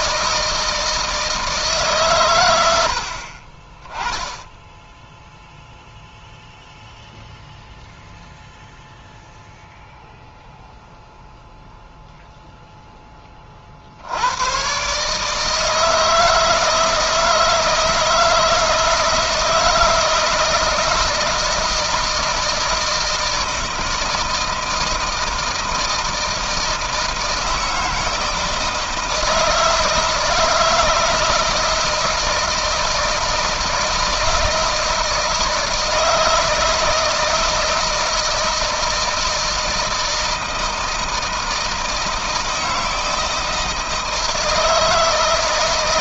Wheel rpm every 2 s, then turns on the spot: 160, 120, 20, 0, 0, 0, 0, 90, 160, 160, 160, 160, 160, 160, 160, 160, 160, 160, 160, 160, 160, 160, 160.
none